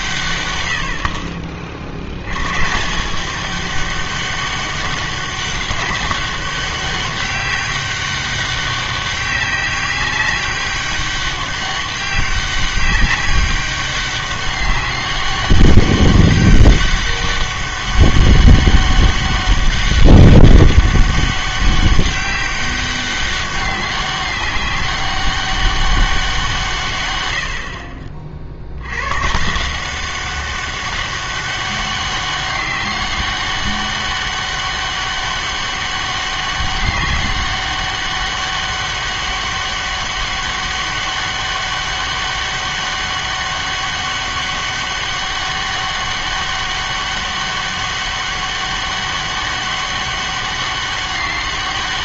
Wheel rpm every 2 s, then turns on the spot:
90, 130, 200, 200, 200, 200, 200, 200, 200, 200, 200, 190, 200, 170, 60, 190, 200, 200, 200, 200, 200, 200, 200, 200, 200, 200.
none